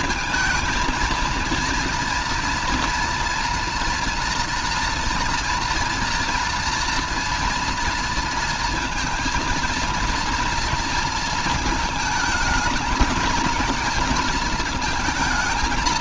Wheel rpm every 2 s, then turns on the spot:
230, 230, 230, 230, 230, 230, 220, 230.
none